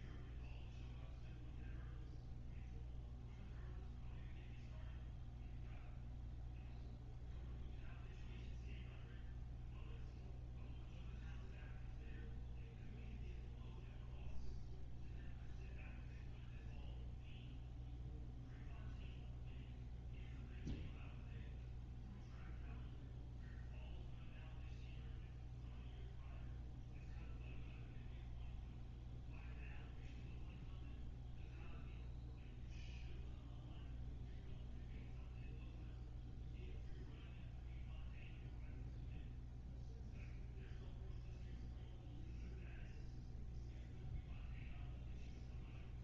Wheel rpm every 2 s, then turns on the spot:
0, 0, 0, 0, 0, 0, 0, 0, 0, 0, 0, 0, 0, 0, 0, 0, 0, 0, 0, 0, 0, 0, 0.
none